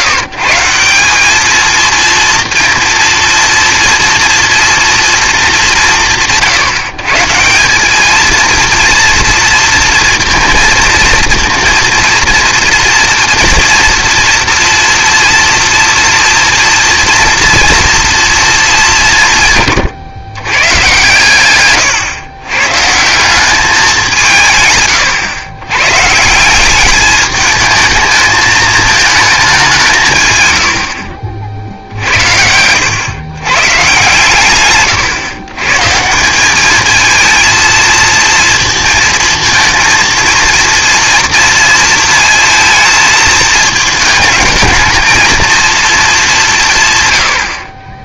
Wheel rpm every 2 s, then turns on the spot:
170, 230, 230, 150, 230, 230, 230, 230, 230, 190, 130, 130, 140, 200, 220, 80, 100, 120, 220, 220, 230, 220, 220, 140.
none